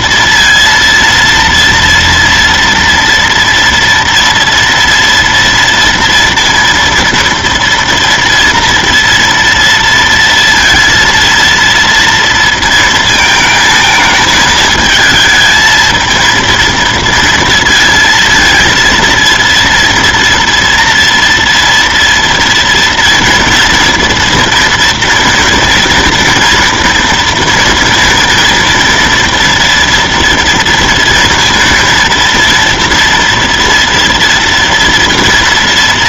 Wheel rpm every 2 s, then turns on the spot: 230, 230, 240, 230, 230, 230, 230, 220, 230, 230, 230, 230, 230, 230, 230, 230, 230, 230.
none